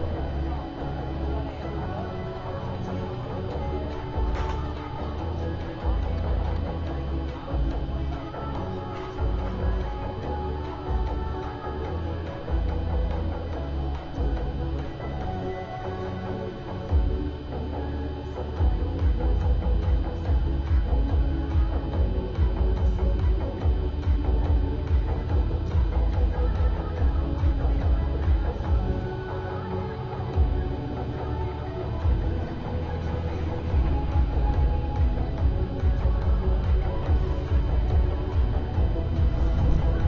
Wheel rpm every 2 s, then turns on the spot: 0, 0, 0, 0, 0, 0, 0, 0, 0, 0, 0, 0, 0, 0, 0, 0, 0, 0, 0, 0.
none